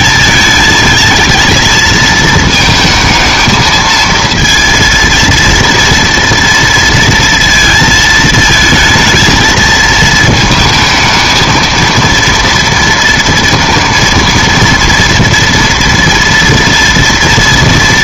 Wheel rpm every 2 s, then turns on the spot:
220, 220, 230, 230, 220, 220, 230, 230, 230.
none